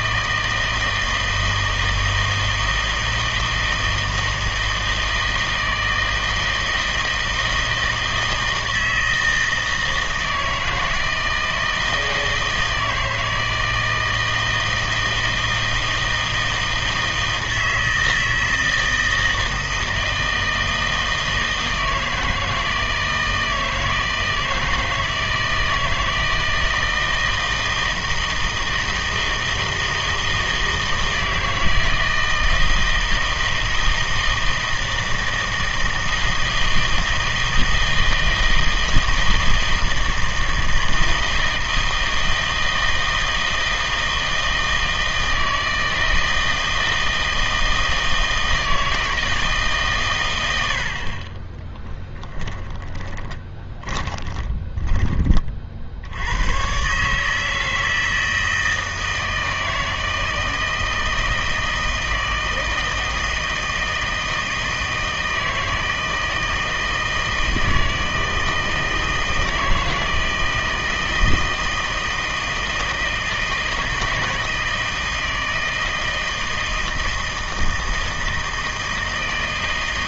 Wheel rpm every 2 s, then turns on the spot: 160, 160, 160, 160, 160, 160, 160, 160, 160, 160, 160, 160, 160, 160, 160, 160, 160, 160, 160, 160, 160, 160, 160, 160, 160, 80, 20, 20, 120, 160, 160, 160, 160, 160, 160, 160, 160, 160, 160, 160.
52-56